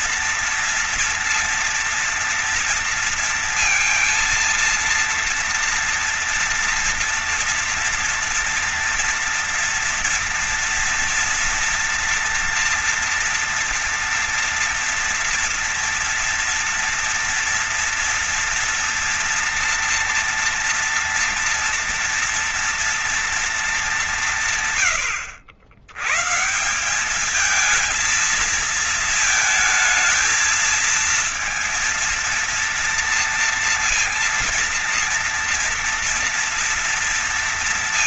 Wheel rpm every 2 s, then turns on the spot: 230, 230, 230, 240, 230, 230, 230, 240, 230, 230, 230, 230, 110, 190, 220, 230, 230, 230, 230.
none